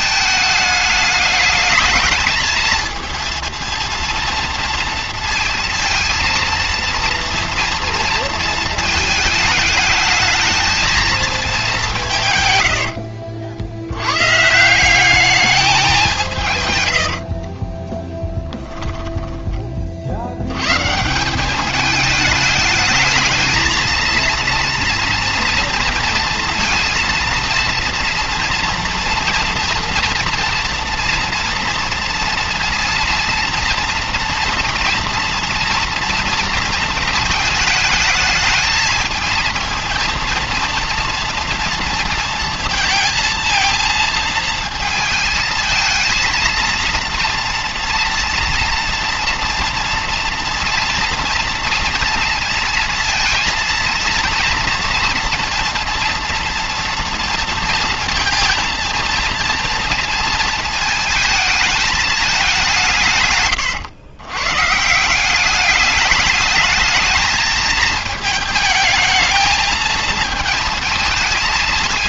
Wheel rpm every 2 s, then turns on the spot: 210, 220, 230, 230, 230, 220, 110, 160, 130, 20, 120, 210, 230, 230, 230, 230, 230, 230, 230, 220, 230, 230, 230, 230, 230, 230, 230, 230, 230, 230, 230, 190, 140, 210, 220, 220.
18-20